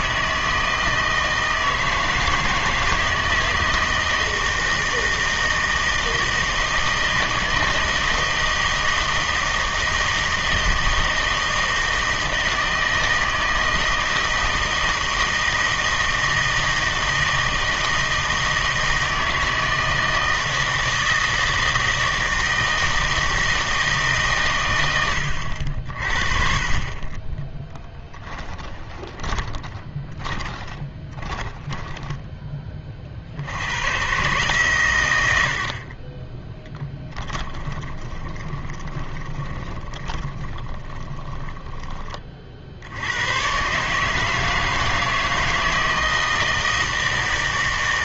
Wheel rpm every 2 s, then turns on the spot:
160, 160, 160, 160, 160, 160, 160, 160, 160, 160, 160, 160, 120, 30, 10, 20, 20, 130, 10, 20, 20, 50, 160, 160.
28-32 36-42